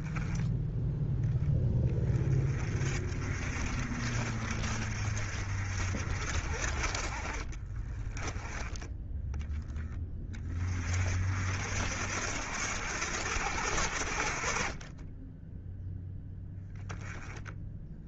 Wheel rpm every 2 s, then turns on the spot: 10, 40, 50, 50, 10, 40, 80, 30, 10.
none